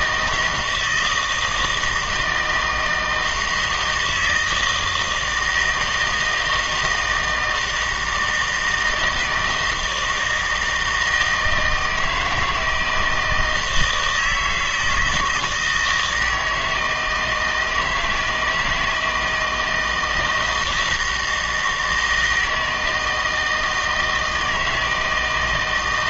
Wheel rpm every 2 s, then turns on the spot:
170, 160, 160, 160, 160, 160, 160, 160, 160, 160, 160, 160, 160.
none